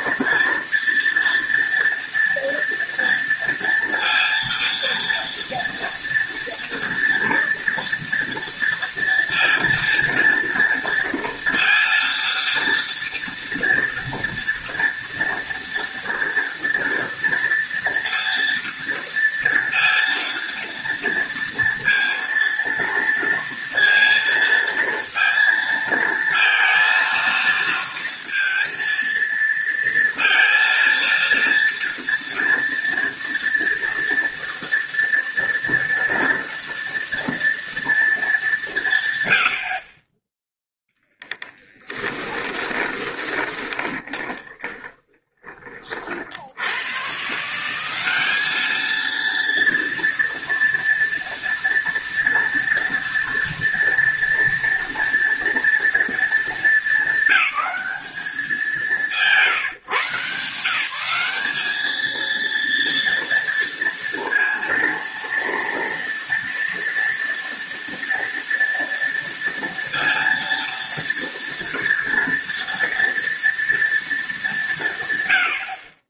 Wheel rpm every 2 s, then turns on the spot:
230, 230, 230, 230, 230, 230, 230, 240, 230, 230, 230, 230, 230, 230, 230, 230, 230, 230, 230, 190, 0, 20, 20, 90, 220, 230, 230, 230, 220, 180, 160, 230, 230, 230, 230, 230, 230, 170.
42-46